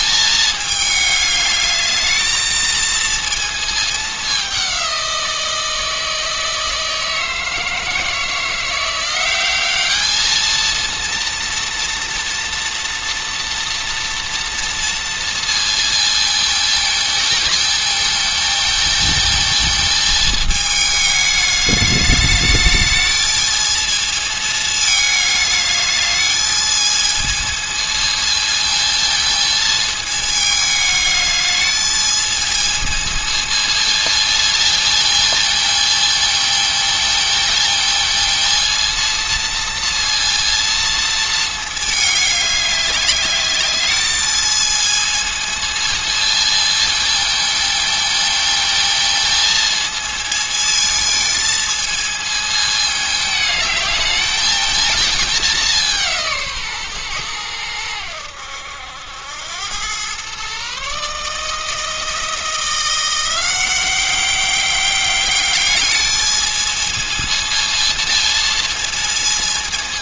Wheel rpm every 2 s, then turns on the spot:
210, 230, 180, 160, 180, 230, 230, 230, 220, 230, 210, 220, 210, 220, 220, 210, 220, 230, 220, 230, 220, 200, 220, 220, 230, 220, 220, 220, 120, 90, 150, 170, 200, 220, 210.
none